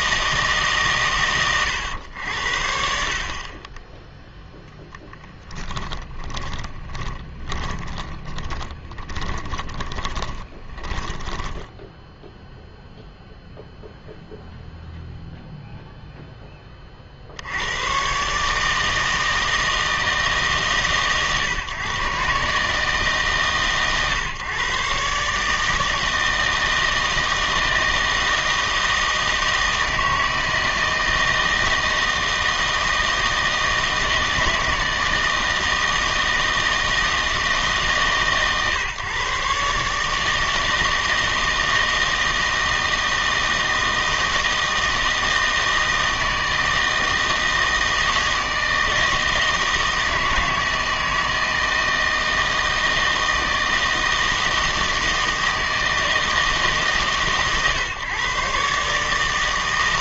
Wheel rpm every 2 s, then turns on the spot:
150, 60, 0, 20, 20, 20, 0, 0, 20, 150, 140, 150, 130, 160, 160, 160, 160, 160, 160, 140, 160, 160, 160, 160, 160, 160, 160, 160, 150, 140.
6-12